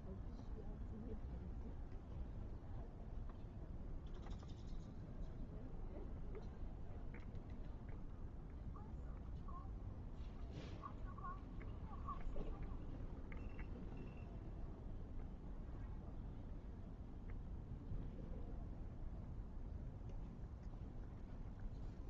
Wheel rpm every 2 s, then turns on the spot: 0, 0, 0, 0, 0, 0, 0, 0, 0, 0, 0.
none